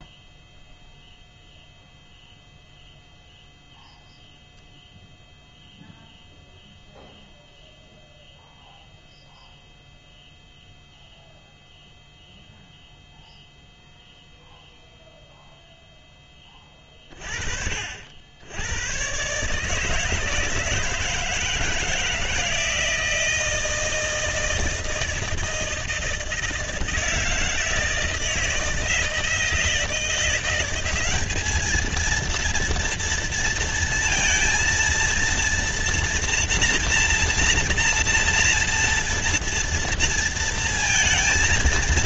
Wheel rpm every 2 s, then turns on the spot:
0, 0, 0, 0, 0, 0, 0, 0, 20, 90, 160, 160, 160, 160, 160, 180, 230, 230, 230, 230, 230.
none